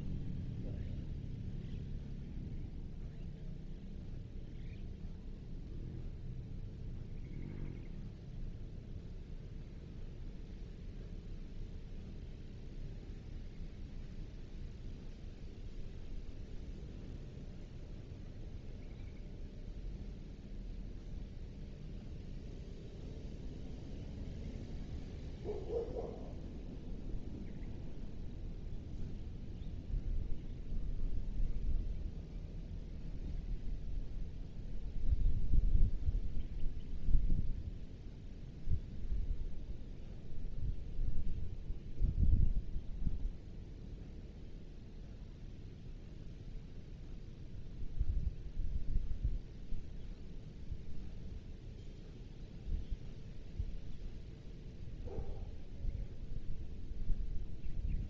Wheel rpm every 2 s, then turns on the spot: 0, 0, 0, 0, 0, 0, 0, 0, 0, 0, 0, 0, 0, 0, 0, 0, 0, 0, 0, 0, 0, 0, 0, 0, 0, 0, 0, 0, 0.
none